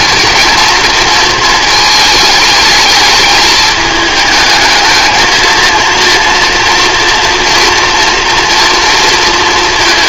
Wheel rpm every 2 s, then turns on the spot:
230, 210, 220, 240, 230.
none